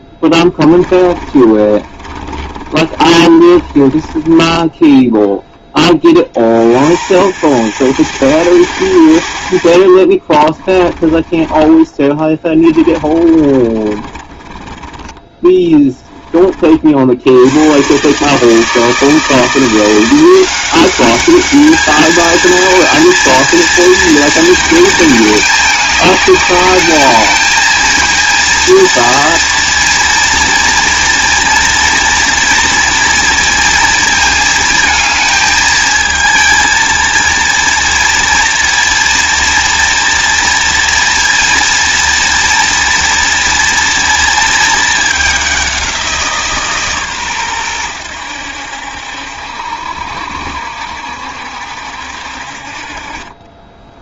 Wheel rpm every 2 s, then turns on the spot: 20, 20, 10, 60, 90, 30, 20, 20, 40, 160, 190, 230, 230, 210, 230, 230, 230, 230, 220, 230, 230, 230, 220, 160, 80, 70, 50.
0-4 10-14